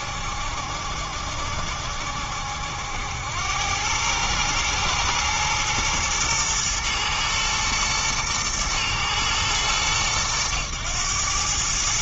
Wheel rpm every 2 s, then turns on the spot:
70, 80, 120, 120, 110, 100.
none